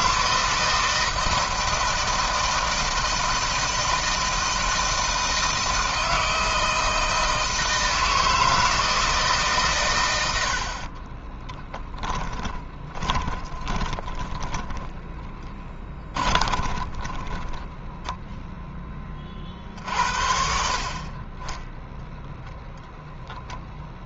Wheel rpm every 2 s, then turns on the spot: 160, 160, 160, 160, 160, 80, 20, 20, 30, 10, 50, 0.
10-18